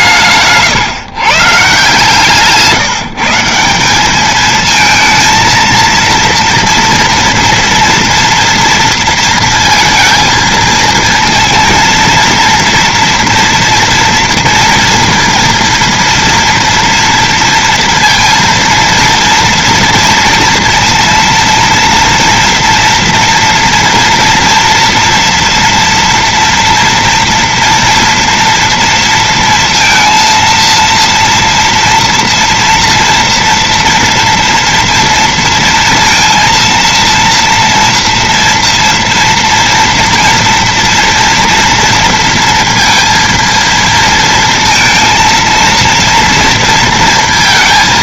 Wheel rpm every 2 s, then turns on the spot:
160, 150, 200, 230, 240, 230, 230, 230, 230, 230, 230, 230, 230, 240, 230, 230, 230, 230, 230, 240, 230, 230, 230, 230.
none